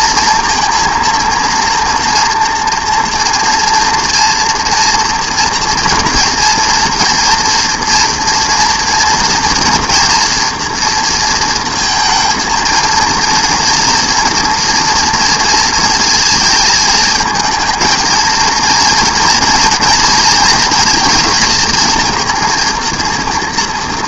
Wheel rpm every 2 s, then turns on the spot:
230, 230, 240, 230, 230, 230, 230, 230, 220, 230, 220, 230.
none